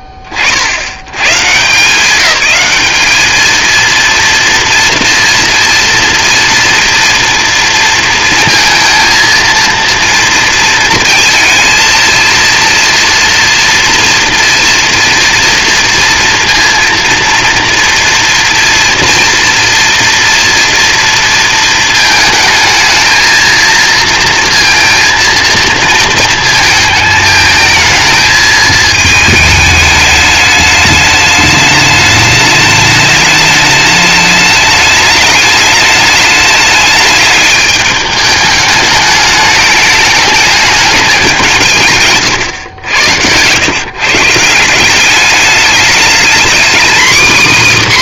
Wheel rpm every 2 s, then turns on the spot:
10, 190, 230, 230, 230, 230, 230, 240, 230, 230, 230, 220, 230, 220, 220, 210, 210, 210, 210, 210, 210, 130, 160, 240.
none